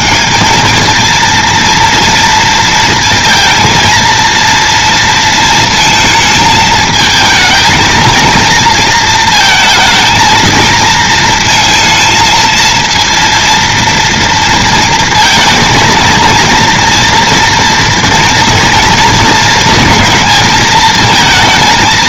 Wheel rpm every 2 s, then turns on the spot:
200, 230, 230, 220, 230, 230, 230, 230, 230, 230, 220.
none